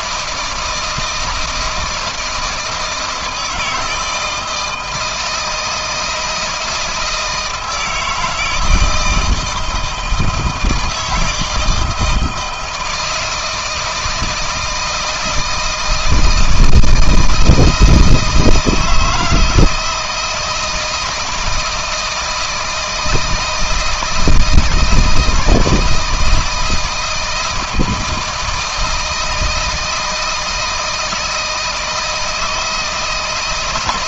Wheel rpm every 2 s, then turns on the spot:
160, 160, 160, 160, 160, 160, 160, 160, 160, 160, 170, 160, 160, 170, 160, 160, 160.
none